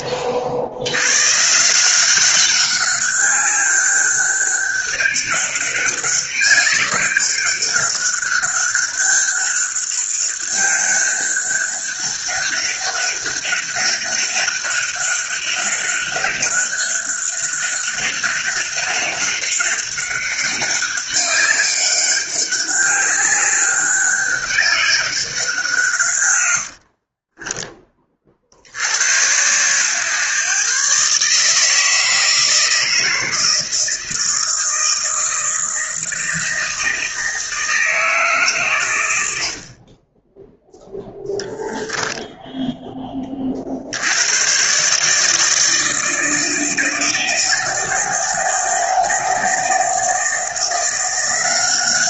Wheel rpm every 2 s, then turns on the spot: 90, 200, 200, 200, 200, 200, 200, 200, 200, 200, 200, 200, 200, 70, 80, 140, 160, 160, 160, 120, 0, 10, 140, 160, 160, 170.
26-28